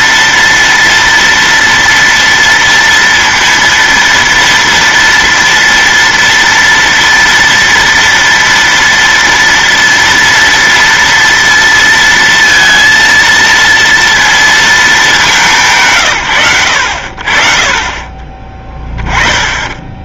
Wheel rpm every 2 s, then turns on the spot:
230, 230, 230, 230, 230, 230, 230, 230, 110, 20.
none